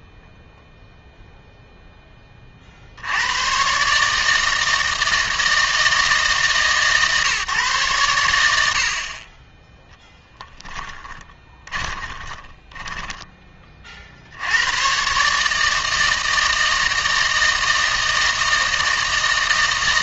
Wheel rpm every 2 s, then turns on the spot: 0, 50, 160, 140, 80, 10, 10, 100, 160, 160.
12-14